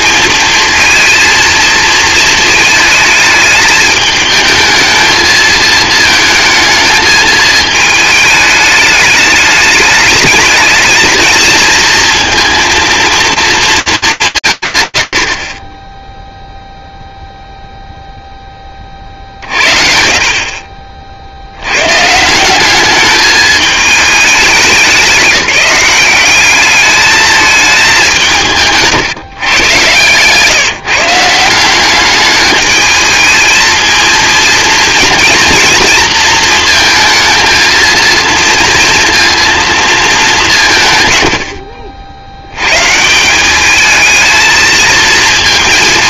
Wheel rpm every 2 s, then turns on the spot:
230, 220, 220, 220, 210, 220, 230, 90, 0, 40, 60, 200, 200, 220, 150, 160, 220, 220, 220, 230, 130, 160, 220.
28-30